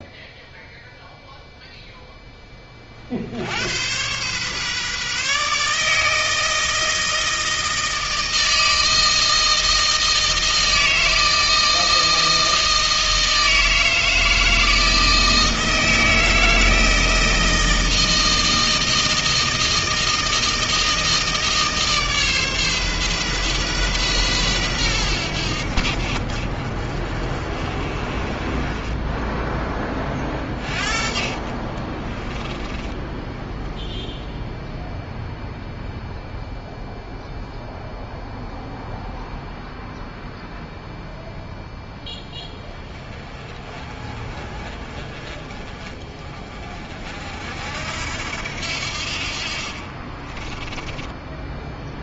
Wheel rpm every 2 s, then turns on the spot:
0, 20, 140, 160, 160, 160, 160, 160, 160, 160, 160, 140, 110, 50, 20, 40, 10, 0, 0, 0, 0, 20, 20, 30, 70, 20.
32-34 50-52